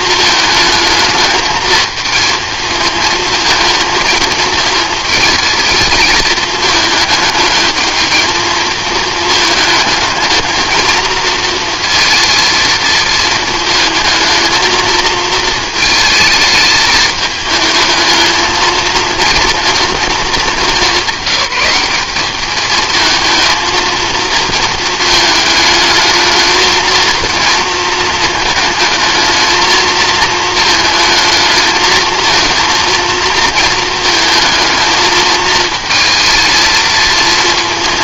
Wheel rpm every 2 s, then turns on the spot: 220, 220, 220, 220, 220, 230, 230, 220, 220, 220, 210, 210, 220, 220, 220, 220, 230, 220, 220.
none